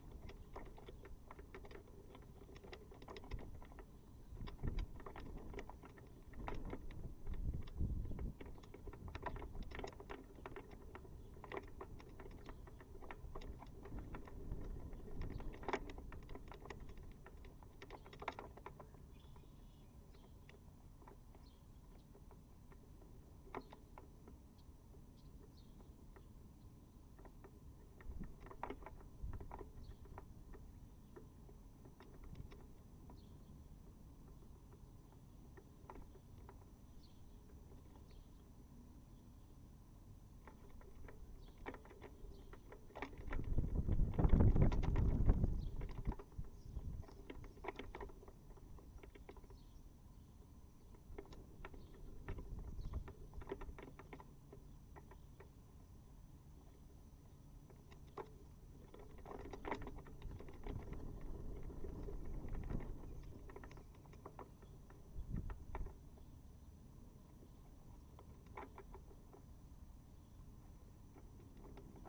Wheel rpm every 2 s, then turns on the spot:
0, 0, 0, 0, 0, 0, 0, 0, 0, 0, 0, 0, 0, 0, 0, 0, 0, 0, 0, 0, 0, 0, 0, 0, 0, 0, 0, 0, 0, 0, 0, 0, 0, 0, 0, 0.
none